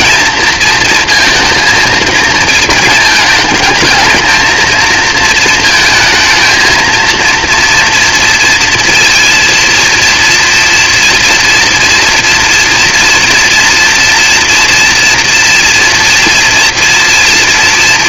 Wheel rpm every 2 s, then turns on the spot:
230, 220, 220, 230, 230, 230, 230, 230, 230.
none